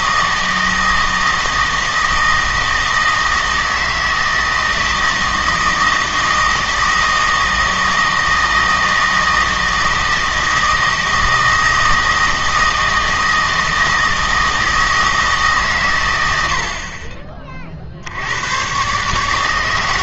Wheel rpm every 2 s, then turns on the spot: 160, 160, 160, 160, 160, 160, 160, 160, 60, 120.
none